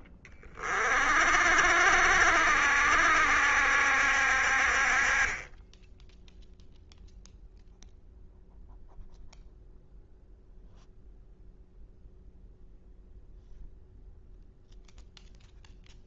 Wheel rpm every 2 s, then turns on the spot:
40, 70, 40, 0, 0, 0, 0, 0.
none